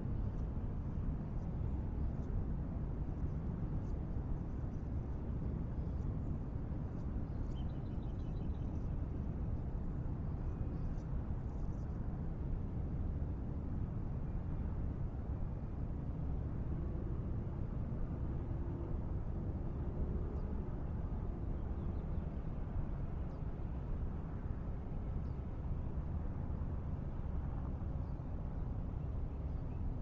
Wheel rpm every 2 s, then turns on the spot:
0, 0, 0, 0, 0, 0, 0, 0, 0, 0, 0, 0, 0, 0, 0.
none